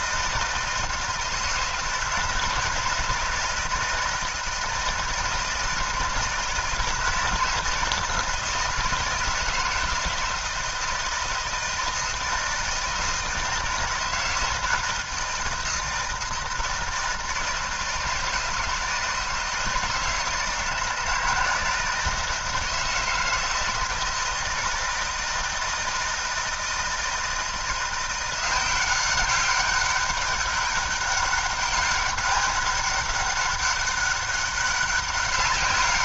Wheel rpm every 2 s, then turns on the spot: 160, 160, 160, 160, 160, 160, 160, 160, 160, 160, 160, 160, 160, 160, 180, 200, 200, 200.
none